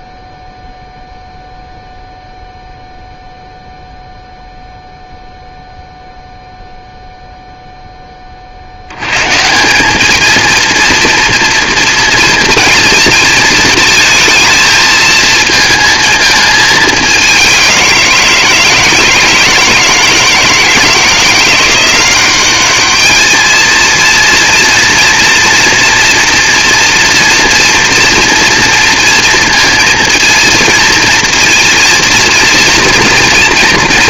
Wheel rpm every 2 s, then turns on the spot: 0, 0, 0, 0, 50, 230, 230, 220, 220, 160, 160, 200, 230, 230, 230, 230, 230.
none